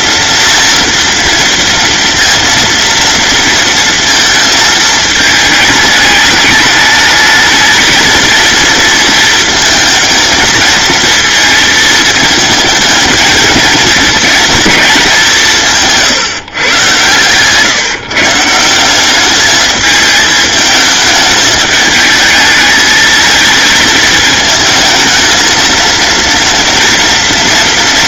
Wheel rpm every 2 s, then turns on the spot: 230, 230, 220, 210, 230, 230, 220, 220, 140, 160, 220, 220, 220, 230.
none